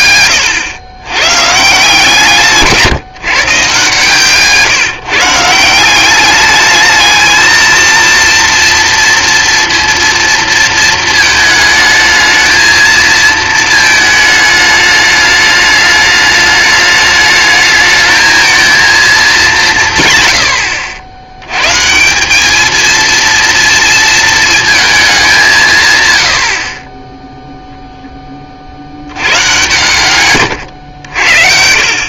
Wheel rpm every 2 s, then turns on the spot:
110, 160, 160, 210, 230, 230, 220, 210, 210, 230, 90, 210, 220, 50, 40, 110.
none